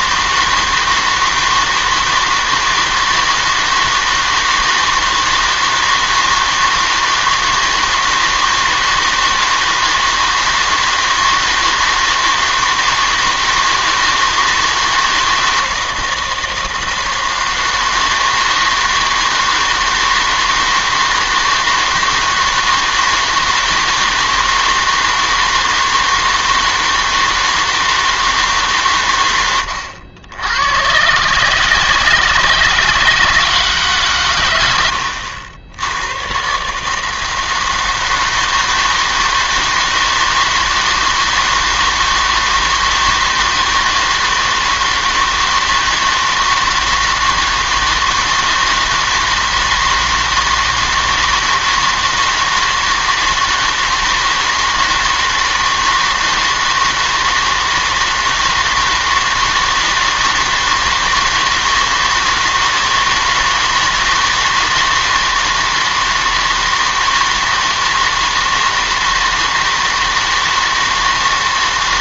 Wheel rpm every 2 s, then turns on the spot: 160, 160, 160, 160, 160, 160, 160, 160, 160, 160, 160, 160, 160, 160, 140, 100, 160, 90, 140, 160, 160, 160, 160, 160, 160, 160, 160, 160, 160, 160, 160, 160, 160, 160, 160, 160.
none